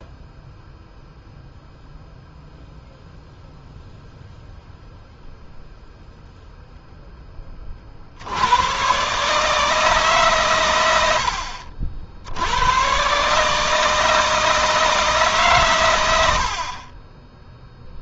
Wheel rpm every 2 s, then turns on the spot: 0, 0, 0, 10, 130, 90, 120, 160, 30.
none